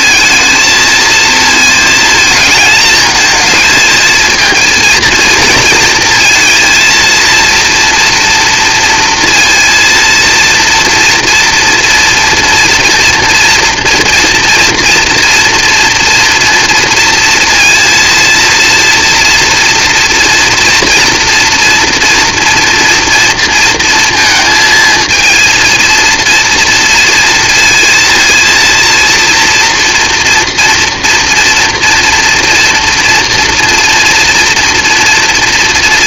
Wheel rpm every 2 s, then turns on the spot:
220, 220, 230, 230, 230, 240, 230, 230, 230, 230, 230, 230, 230, 230, 230, 230, 230, 240.
none